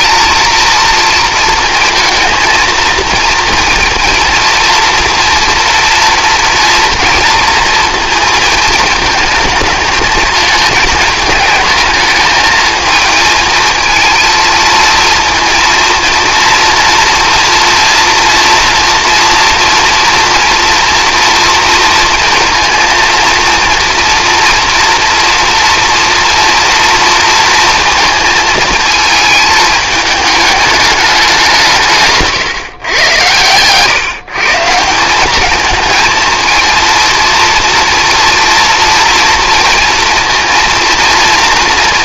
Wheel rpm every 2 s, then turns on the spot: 230, 230, 230, 230, 220, 220, 220, 230, 230, 230, 230, 230, 230, 230, 220, 210, 130, 160, 230, 230, 230.
none